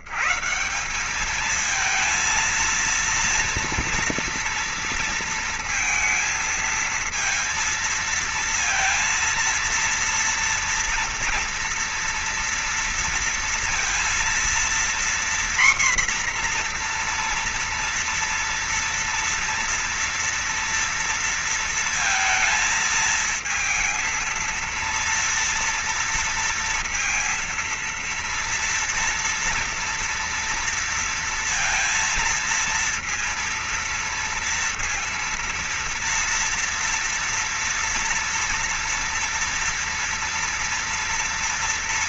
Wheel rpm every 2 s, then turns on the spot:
140, 230, 240, 230, 230, 230, 230, 230, 250, 240, 230, 230, 230, 230, 230, 230, 230, 230, 230, 240, 240.
none